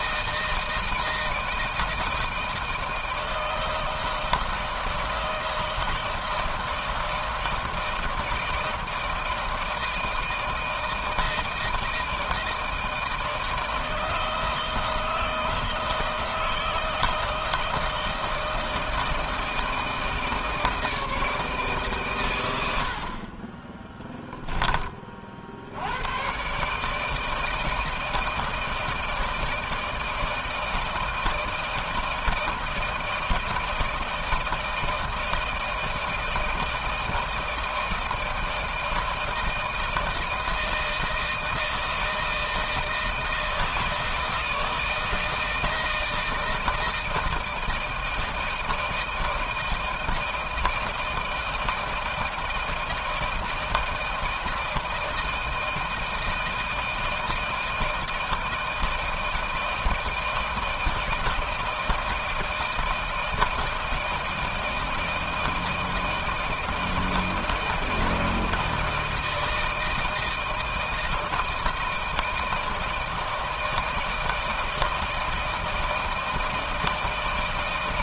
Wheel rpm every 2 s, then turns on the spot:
160, 160, 160, 160, 160, 160, 160, 160, 160, 160, 160, 110, 10, 120, 160, 160, 160, 160, 160, 160, 160, 160, 160, 160, 160, 160, 160, 160, 160, 160, 160, 160, 160, 160, 160, 160, 160, 160, 160.
none